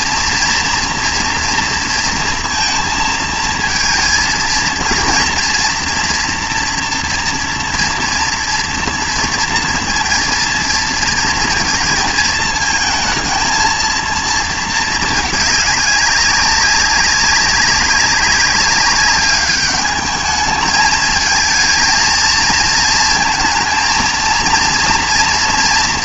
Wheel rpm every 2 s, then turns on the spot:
230, 230, 230, 240, 230, 220, 220, 230, 190, 200, 210, 230, 230.
none